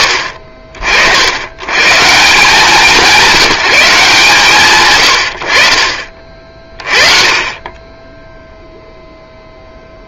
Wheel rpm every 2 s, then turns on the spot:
70, 180, 120, 30, 0.
none